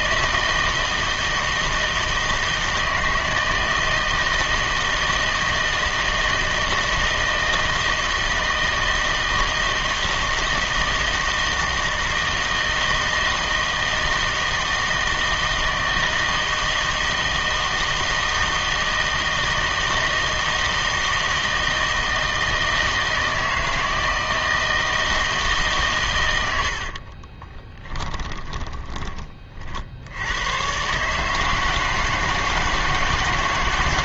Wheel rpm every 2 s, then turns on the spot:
160, 160, 160, 160, 160, 160, 160, 160, 160, 160, 160, 160, 160, 70, 10, 120, 160.
26-30